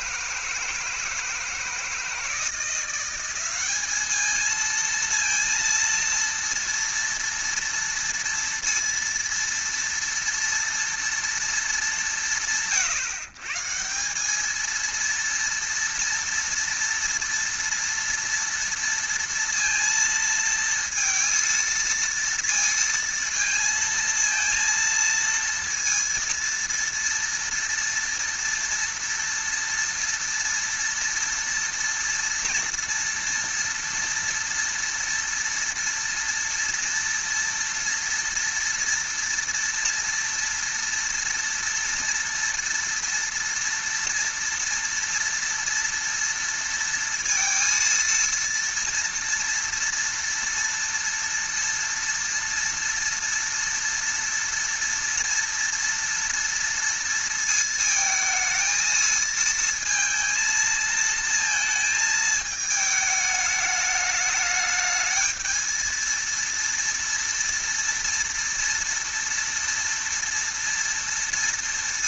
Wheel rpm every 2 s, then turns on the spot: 160, 170, 220, 230, 230, 230, 120, 210, 230, 230, 230, 230, 230, 230, 230, 230, 230, 230, 230, 230, 230, 230, 230, 230, 230, 230, 230, 230, 230, 220, 230, 220, 210, 230, 230, 230.
none